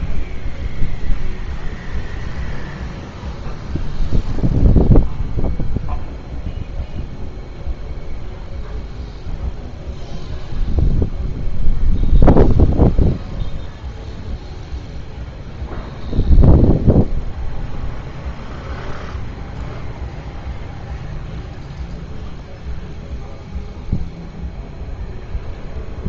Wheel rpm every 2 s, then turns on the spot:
0, 0, 0, 0, 0, 0, 0, 0, 0, 0, 0, 0, 0.
none